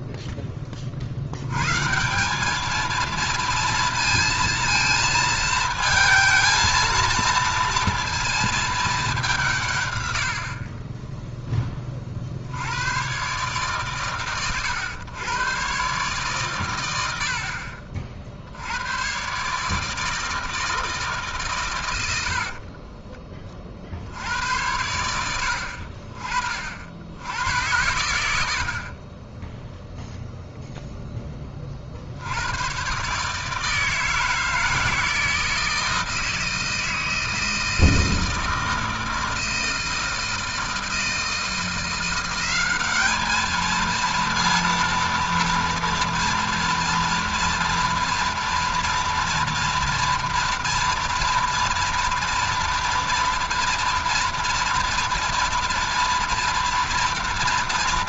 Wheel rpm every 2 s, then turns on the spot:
20, 220, 230, 230, 220, 60, 70, 110, 120, 70, 160, 60, 90, 40, 80, 0, 100, 160, 160, 160, 160, 190, 230, 230, 230, 240, 240, 230, 230.
10-12